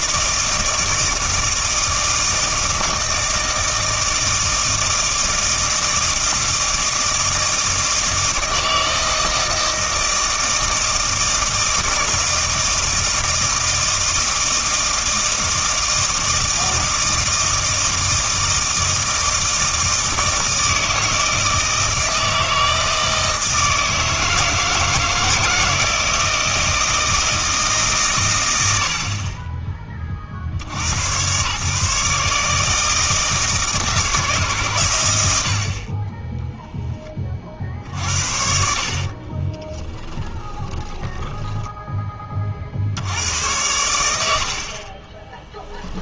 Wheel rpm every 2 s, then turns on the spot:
160, 160, 160, 160, 160, 160, 160, 160, 160, 160, 160, 160, 160, 160, 70, 90, 160, 120, 10, 60, 20, 70, 40.
40-42 44-46